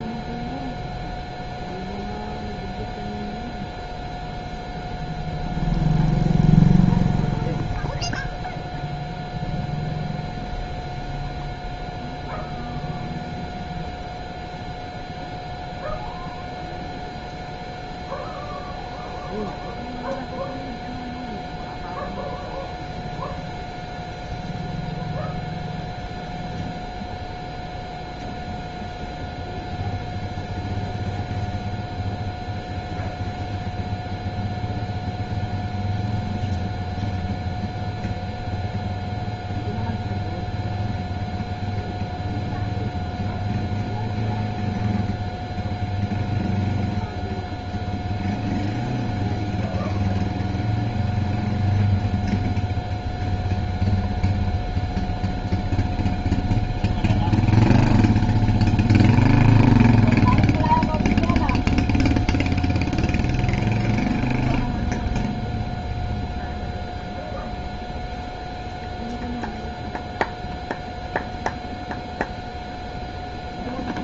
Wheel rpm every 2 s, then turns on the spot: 0, 0, 0, 0, 0, 0, 0, 0, 0, 0, 0, 0, 0, 0, 0, 0, 0, 0, 0, 0, 0, 0, 0, 0, 0, 0, 0, 0, 0, 0, 0, 0, 0, 0, 0, 0, 0.
none